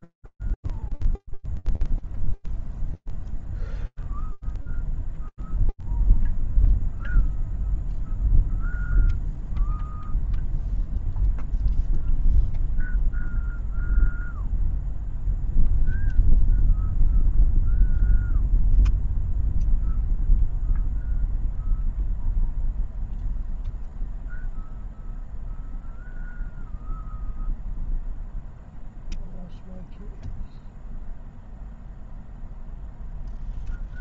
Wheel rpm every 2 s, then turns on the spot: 0, 0, 0, 0, 0, 0, 0, 0, 0, 0, 0, 0, 0, 0, 0, 0, 0.
none